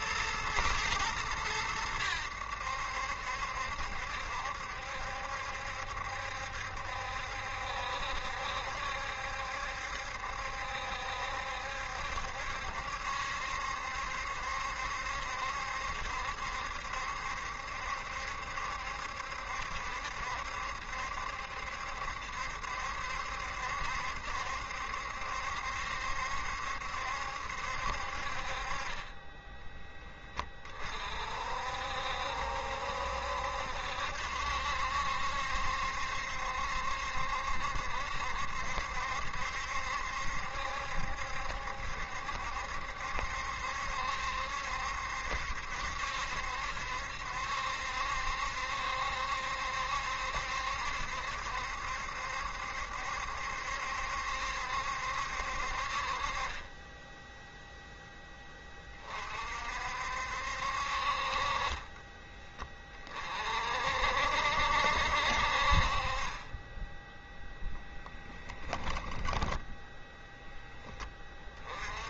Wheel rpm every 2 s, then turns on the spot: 110, 70, 70, 70, 70, 70, 70, 70, 70, 70, 70, 70, 70, 70, 30, 40, 70, 70, 70, 70, 70, 70, 70, 70, 70, 70, 70, 70, 10, 30, 50, 30, 60, 10, 10, 10.
68-70